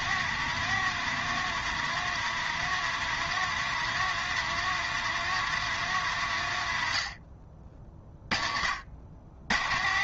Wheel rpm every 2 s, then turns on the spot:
170, 160, 170, 80, 70.
none